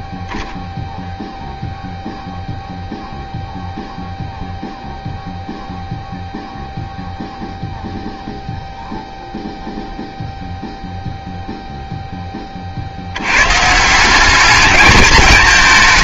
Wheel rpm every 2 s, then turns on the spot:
0, 0, 0, 0, 0, 0, 30, 200.
none